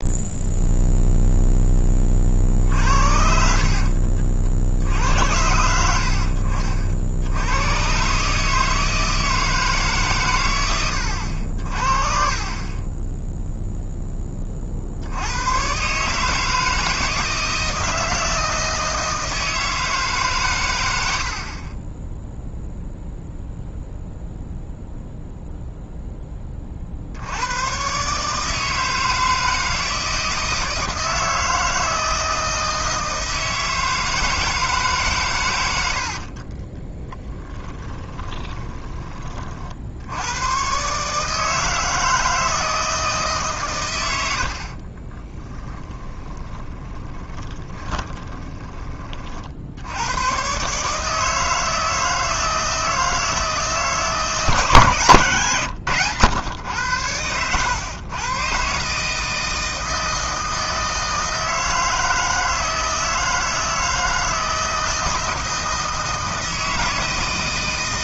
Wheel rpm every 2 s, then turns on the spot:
0, 50, 60, 60, 160, 100, 30, 50, 160, 160, 110, 0, 0, 40, 160, 160, 160, 150, 30, 20, 120, 160, 60, 20, 20, 140, 160, 160, 100, 140, 160, 160, 160, 160.
2-4 36-40 44-48